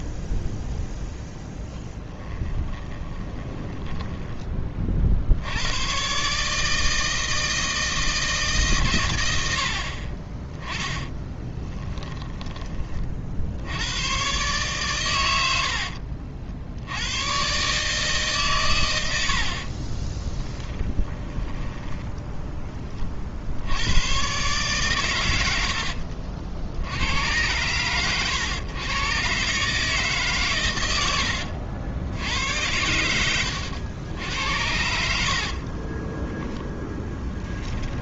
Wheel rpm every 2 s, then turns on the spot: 0, 20, 30, 150, 150, 10, 20, 130, 60, 110, 10, 20, 130, 80, 120, 110, 80, 80, 10.
2-4 10-12 20-22 34-38